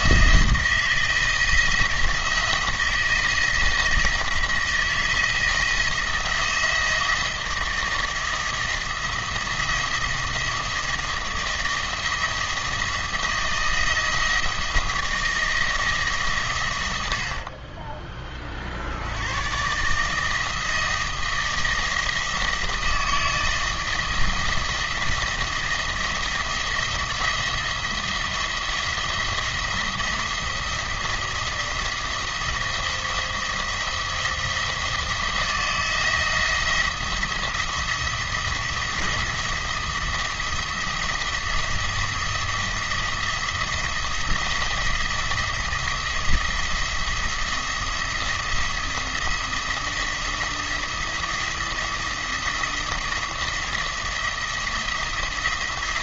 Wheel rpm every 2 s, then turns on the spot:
160, 170, 160, 170, 160, 160, 160, 160, 110, 60, 160, 160, 170, 170, 170, 170, 170, 170, 170, 170, 170, 170, 170, 170, 170, 170, 170, 170.
none